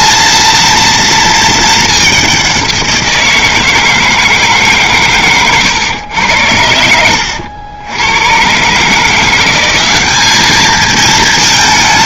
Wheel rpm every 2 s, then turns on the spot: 230, 190, 150, 90, 130, 220.
none